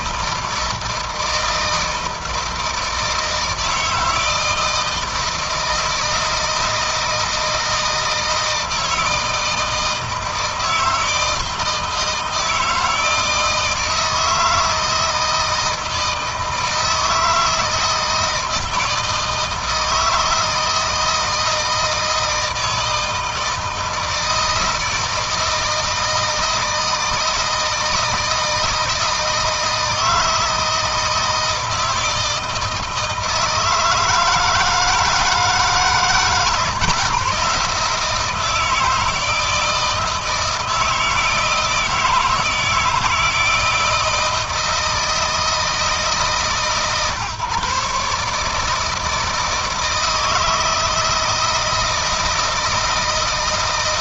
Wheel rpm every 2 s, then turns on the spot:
160, 160, 160, 160, 160, 160, 160, 160, 160, 160, 160, 160, 160, 160, 160, 160, 160, 160, 140, 160, 160, 160, 160, 140, 160, 160, 160.
none